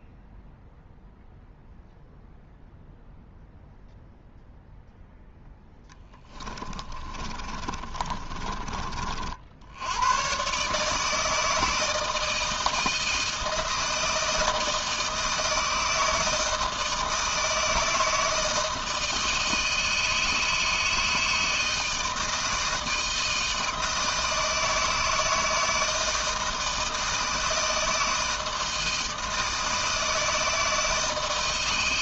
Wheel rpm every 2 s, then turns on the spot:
0, 0, 0, 30, 30, 140, 160, 160, 160, 160, 160, 160, 160, 160, 160, 160.
6-8